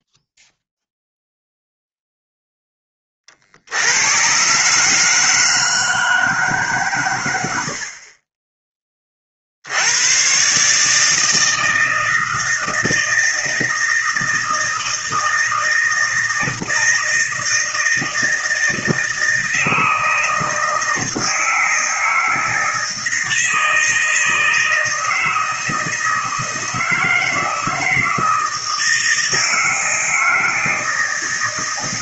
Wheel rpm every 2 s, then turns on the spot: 0, 10, 140, 140, 20, 150, 160, 160, 160, 160, 160, 160, 160, 160, 160, 160.
none